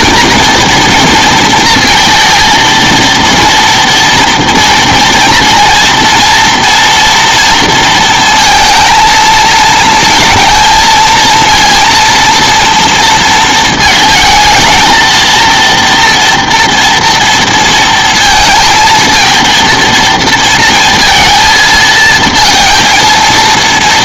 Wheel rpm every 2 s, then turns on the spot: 230, 230, 230, 230, 230, 230, 230, 220, 230, 230, 230, 230.
none